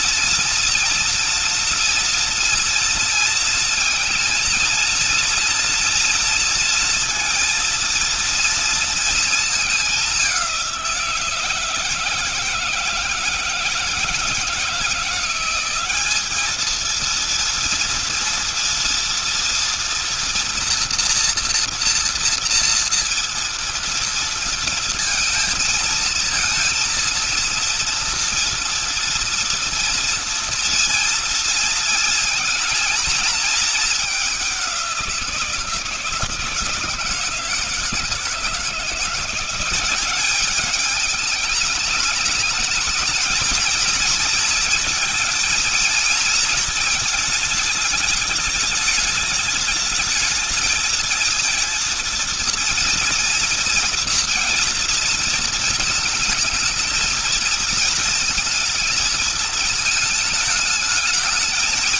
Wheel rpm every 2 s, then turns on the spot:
230, 230, 230, 230, 230, 190, 160, 160, 210, 230, 240, 230, 230, 230, 230, 230, 230, 190, 160, 160, 200, 210, 220, 230, 210, 220, 230, 230, 220, 220, 220.
none